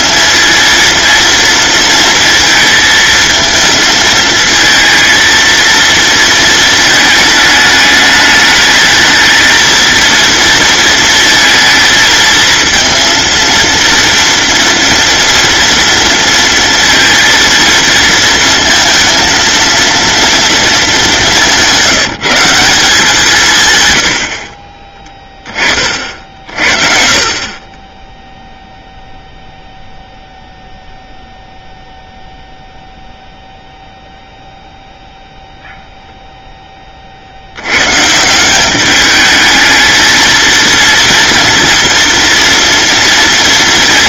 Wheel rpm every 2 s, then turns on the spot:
230, 230, 230, 220, 220, 230, 220, 230, 230, 230, 230, 180, 40, 50, 0, 0, 0, 0, 0, 190, 230, 230.
none